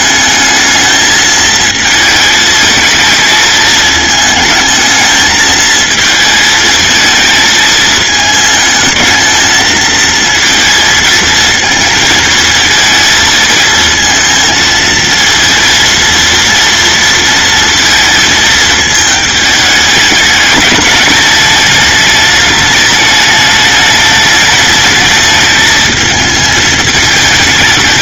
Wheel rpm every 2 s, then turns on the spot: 220, 220, 220, 220, 220, 230, 230, 220, 230, 220, 210, 210, 210, 220.
none